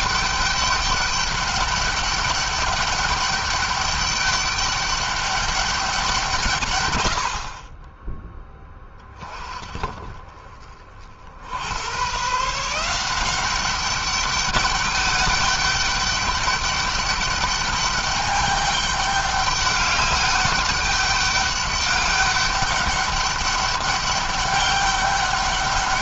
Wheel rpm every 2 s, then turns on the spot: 200, 200, 200, 110, 10, 40, 170, 200, 200, 200, 200, 200, 200.
none